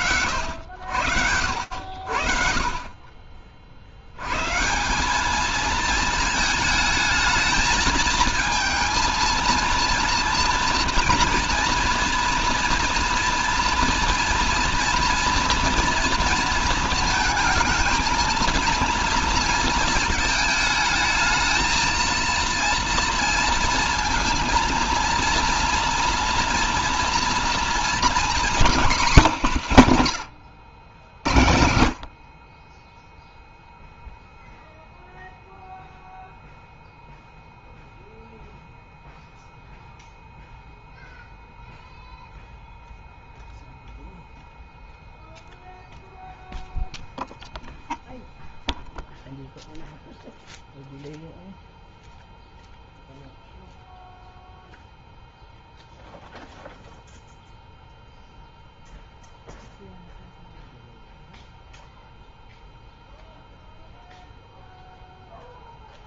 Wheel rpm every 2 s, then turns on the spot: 100, 30, 190, 220, 230, 230, 230, 230, 220, 230, 220, 230, 230, 240, 220, 80, 40, 0, 0, 0, 0, 0, 0, 0, 0, 0, 0, 0, 0, 0, 0, 0, 0.
none